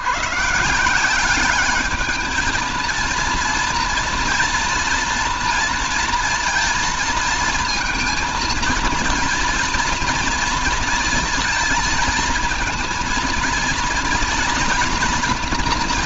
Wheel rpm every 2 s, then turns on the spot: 150, 220, 240, 230, 230, 230, 230, 230.
none